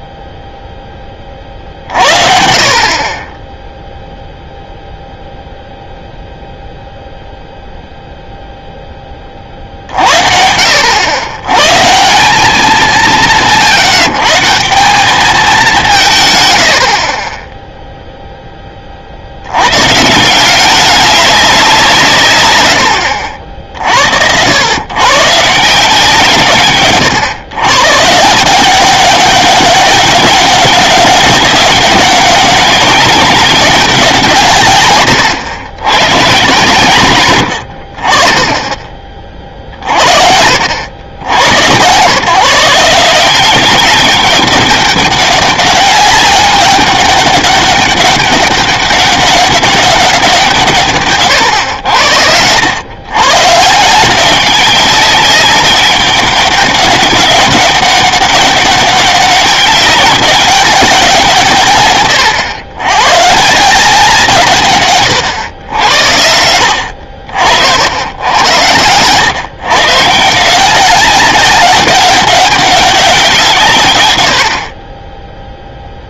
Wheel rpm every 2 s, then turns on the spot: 0, 50, 0, 0, 0, 70, 190, 180, 60, 20, 180, 120, 100, 140, 180, 190, 190, 140, 130, 20, 80, 150, 200, 200, 200, 170, 90, 190, 200, 200, 200, 120, 140, 80, 100, 170, 200, 60.
none